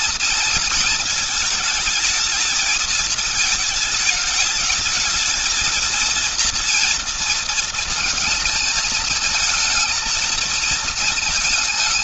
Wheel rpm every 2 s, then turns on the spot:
230, 220, 220, 230, 220, 220.
none